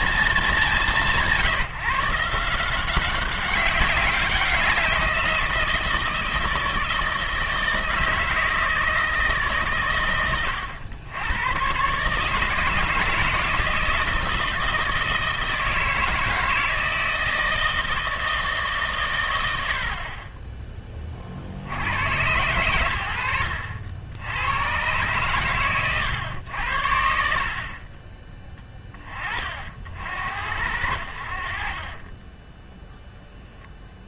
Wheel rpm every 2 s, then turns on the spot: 170, 180, 180, 160, 160, 100, 160, 160, 160, 160, 20, 110, 110, 80, 30, 80, 10.
none